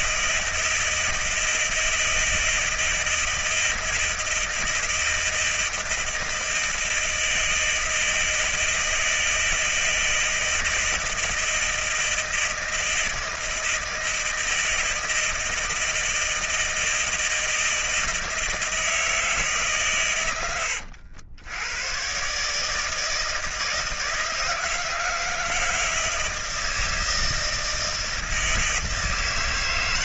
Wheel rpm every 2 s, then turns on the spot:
160, 160, 160, 160, 160, 160, 160, 160, 160, 160, 120, 130, 160, 160, 160.
none